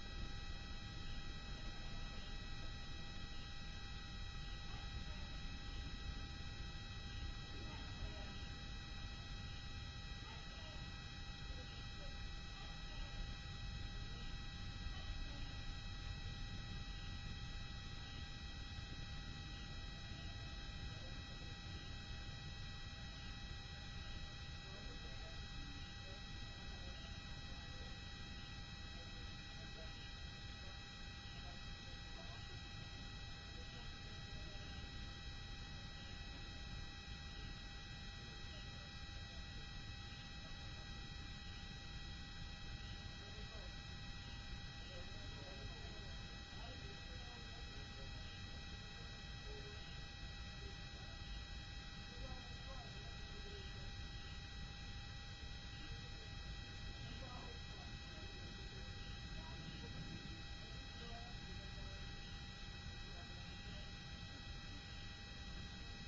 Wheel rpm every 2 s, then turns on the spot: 0, 0, 0, 0, 0, 0, 0, 0, 0, 0, 0, 0, 0, 0, 0, 0, 0, 0, 0, 0, 0, 0, 0, 0, 0, 0, 0, 0, 0, 0, 0, 0, 0.
none